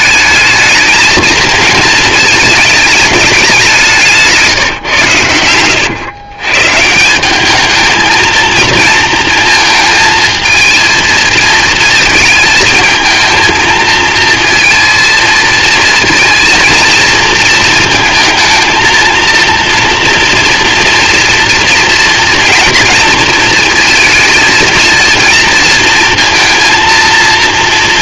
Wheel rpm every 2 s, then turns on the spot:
220, 210, 140, 140, 230, 230, 220, 230, 230, 230, 230, 230, 230, 230.
4-6